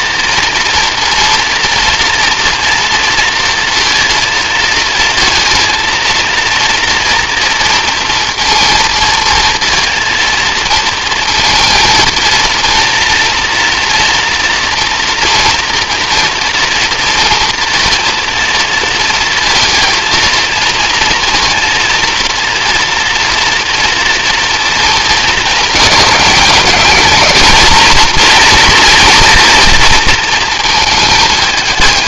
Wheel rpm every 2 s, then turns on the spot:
230, 230, 230, 230, 230, 230, 230, 240, 230, 230, 220, 230, 220, 210, 230, 220.
none